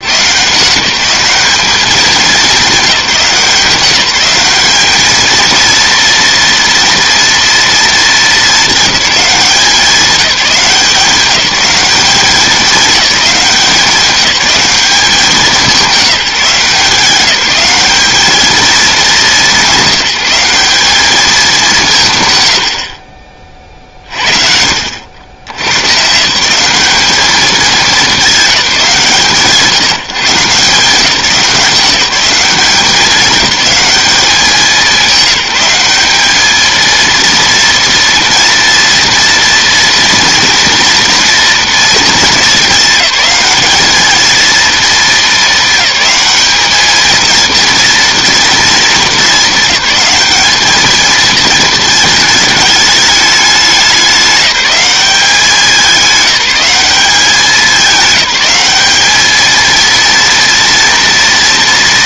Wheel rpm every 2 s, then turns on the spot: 190, 170, 220, 230, 200, 180, 200, 200, 180, 210, 210, 50, 80, 210, 160, 180, 200, 190, 230, 240, 240, 210, 220, 220, 210, 220, 210, 190, 200, 210, 230.
none